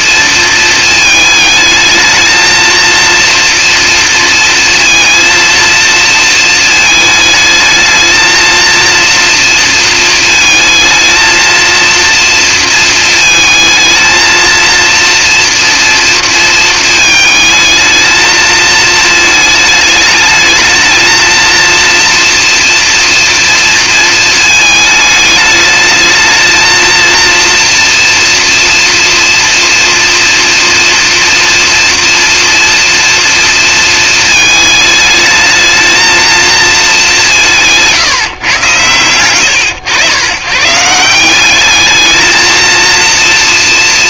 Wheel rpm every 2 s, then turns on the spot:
220, 230, 230, 220, 230, 230, 220, 230, 220, 220, 220, 230, 220, 230, 240, 230, 230, 210, 210, 110, 170, 230.
none